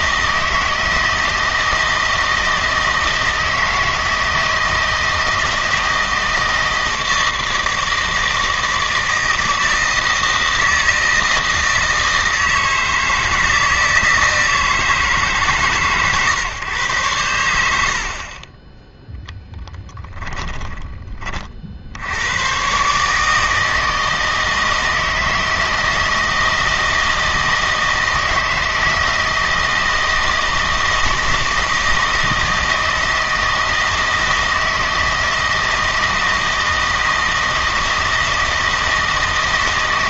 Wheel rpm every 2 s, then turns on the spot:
160, 160, 160, 160, 160, 160, 160, 160, 120, 10, 20, 140, 160, 160, 160, 160, 160, 160, 160, 160.
18-20